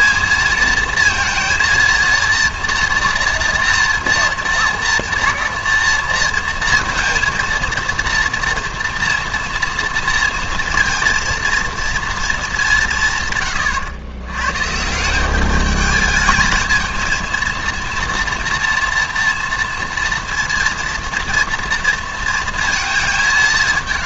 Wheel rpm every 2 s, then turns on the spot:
220, 230, 230, 230, 230, 230, 200, 140, 220, 230, 230, 230.
none